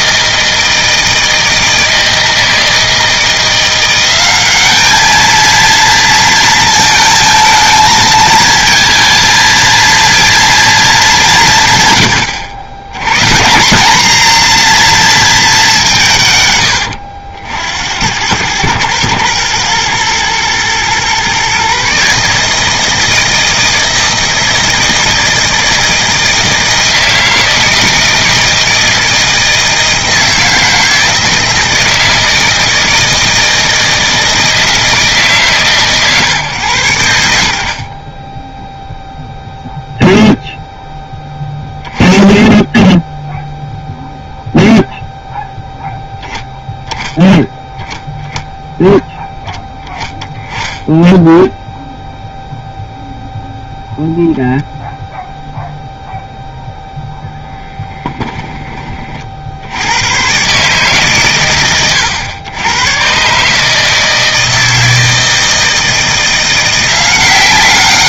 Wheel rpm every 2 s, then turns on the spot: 160, 160, 220, 220, 230, 210, 110, 230, 90, 110, 120, 160, 160, 160, 160, 160, 160, 160, 100, 0, 0, 10, 0, 0, 10, 10, 0, 0, 0, 30, 140, 120, 160, 180.
none